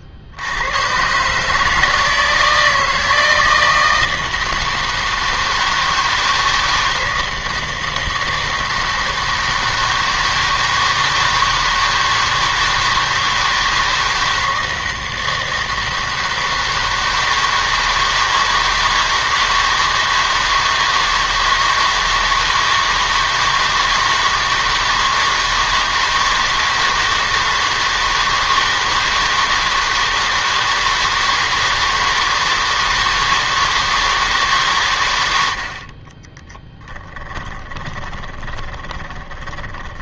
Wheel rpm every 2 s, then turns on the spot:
100, 160, 160, 160, 160, 160, 160, 160, 160, 160, 160, 160, 160, 160, 160, 160, 160, 140, 10, 20.
36-40